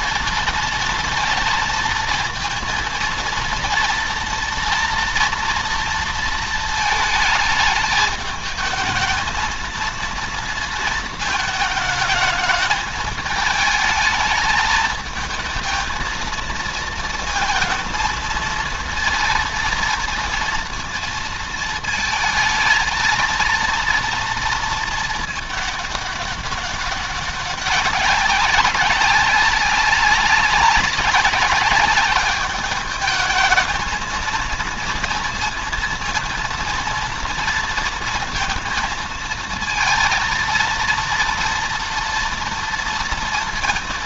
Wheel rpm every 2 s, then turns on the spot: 230, 230, 230, 220, 220, 230, 220, 220, 230, 230, 230, 230, 230, 200, 200, 200, 210, 220, 230, 230, 230, 230.
none